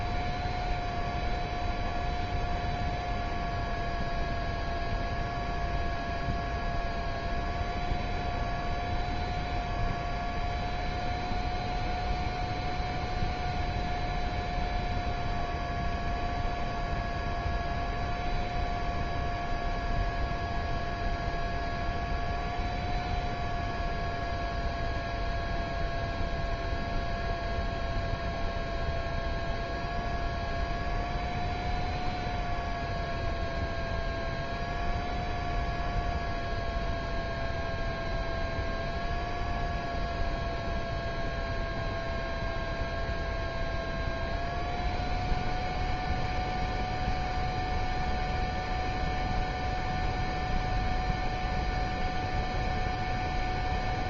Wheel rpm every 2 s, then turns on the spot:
0, 0, 0, 0, 0, 0, 0, 0, 0, 0, 0, 0, 0, 0, 0, 0, 0, 0, 0, 0, 0, 0, 0, 0, 0, 0, 0.
none